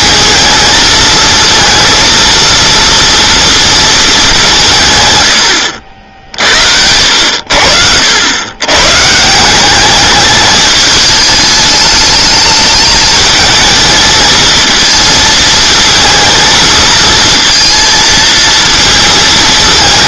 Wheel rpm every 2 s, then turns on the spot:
220, 230, 170, 70, 110, 210, 210, 230, 230, 230.
none